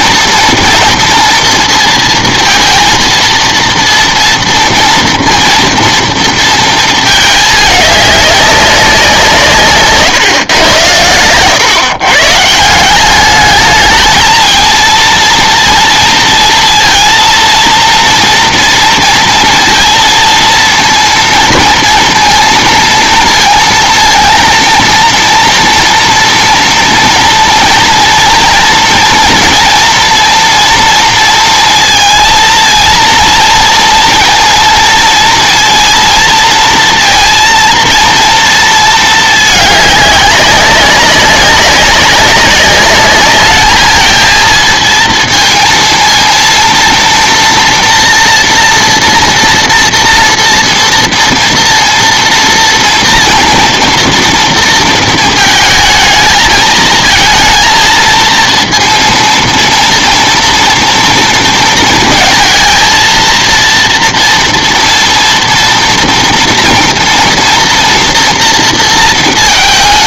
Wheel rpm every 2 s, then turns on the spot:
230, 230, 230, 230, 200, 110, 160, 220, 230, 230, 230, 230, 230, 230, 230, 230, 230, 230, 230, 230, 200, 200, 230, 230, 240, 230, 230, 230, 220, 230, 230, 230, 230, 230, 230.
none